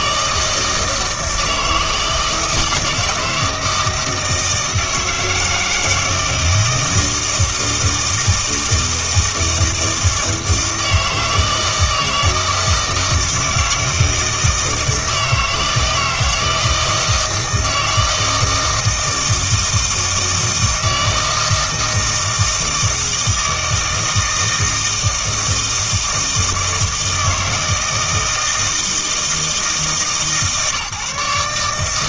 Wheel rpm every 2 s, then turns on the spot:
160, 160, 160, 160, 160, 160, 160, 160, 160, 160, 160, 160, 160, 160, 160, 140.
none